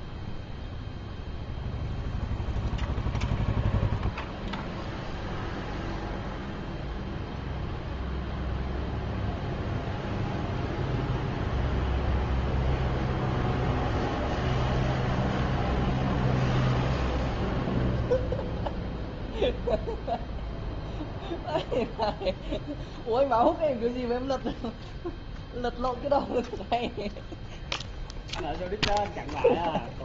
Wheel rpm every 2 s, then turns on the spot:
0, 0, 0, 0, 0, 0, 0, 0, 0, 0, 0, 0, 0, 0, 0.
none